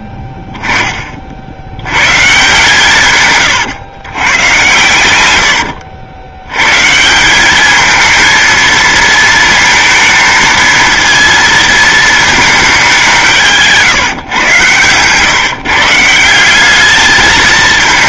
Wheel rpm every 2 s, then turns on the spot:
20, 150, 110, 150, 230, 230, 180, 130, 210.
4-6